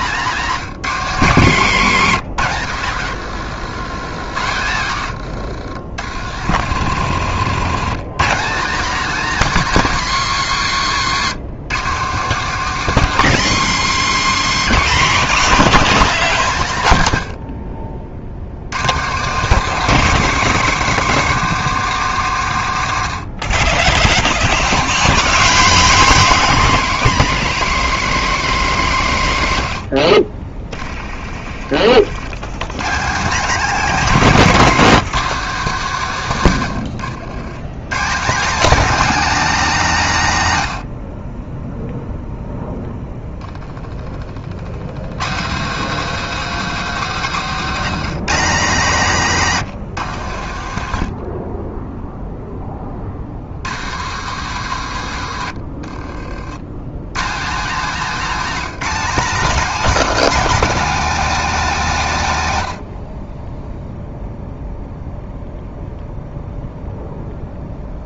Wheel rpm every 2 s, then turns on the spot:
180, 130, 120, 90, 240, 200, 220, 190, 140, 140, 180, 120, 70, 160, 120, 0, 130, 180, 100, 260, 70, 0, 80, 150, 180, 50, 30, 130, 130, 240, 270, 80, 0, 0.
6-8 36-38 46-48 50-52